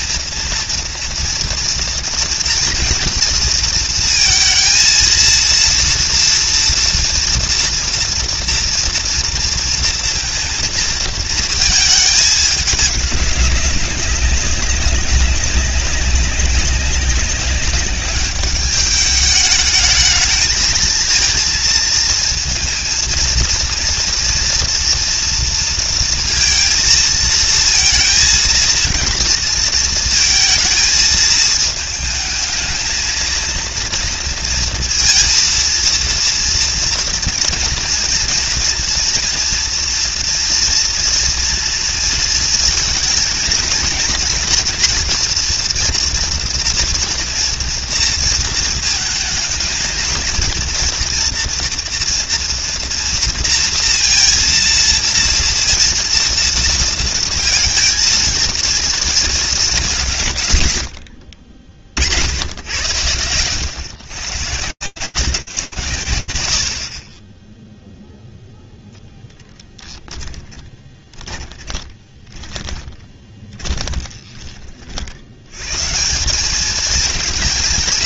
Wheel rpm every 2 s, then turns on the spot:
230, 230, 230, 230, 230, 230, 210, 190, 200, 210, 220, 230, 230, 230, 230, 230, 220, 230, 230, 240, 230, 230, 240, 240, 230, 230, 230, 230, 230, 230, 110, 100, 160, 90, 0, 20, 20, 60, 210.
70-74